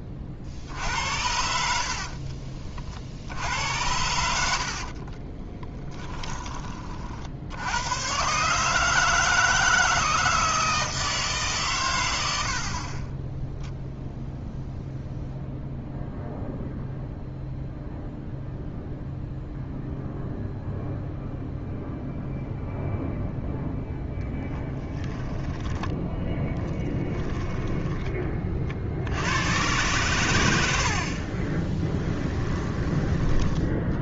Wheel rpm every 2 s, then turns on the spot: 40, 40, 60, 20, 140, 160, 60, 0, 0, 0, 0, 0, 10, 10, 40, 80, 10.
4-6 12-14 26-28 32-34